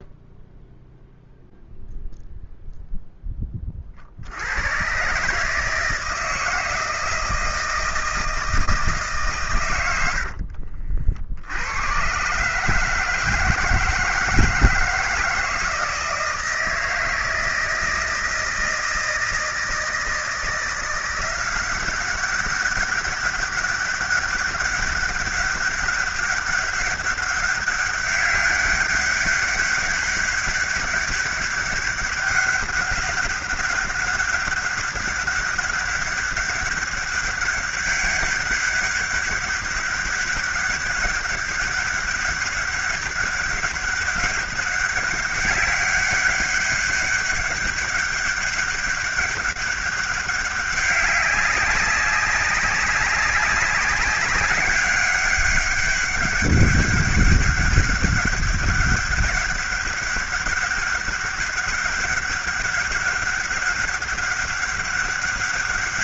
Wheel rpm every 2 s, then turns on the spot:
0, 10, 140, 160, 130, 80, 160, 160, 160, 160, 180, 200, 200, 200, 200, 200, 200, 200, 200, 200, 200, 200, 200, 200, 200, 200, 190, 200, 200, 200, 200, 200, 200.
none